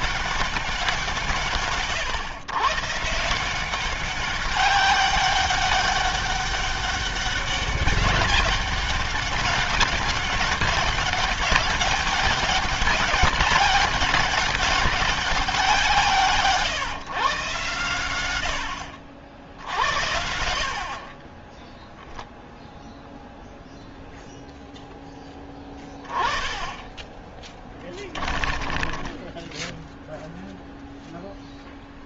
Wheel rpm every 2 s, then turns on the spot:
200, 120, 200, 200, 200, 200, 200, 200, 150, 100, 50, 0, 0, 20, 20, 0.
28-30